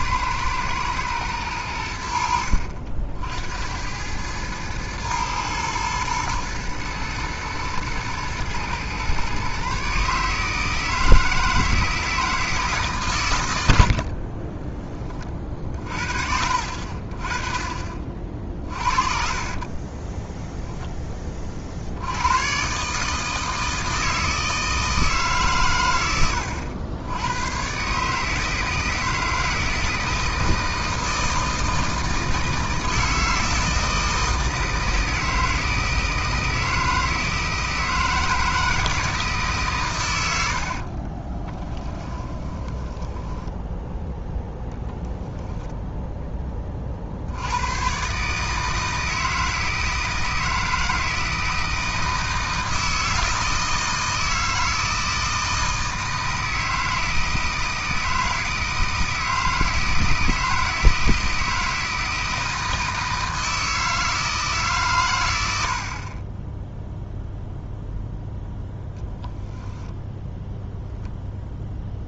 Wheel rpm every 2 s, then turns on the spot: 110, 70, 110, 110, 120, 160, 150, 30, 50, 40, 10, 140, 160, 90, 160, 160, 160, 160, 160, 160, 40, 10, 0, 30, 160, 160, 160, 160, 160, 160, 160, 160, 130, 0, 0, 0.
18-20 40-44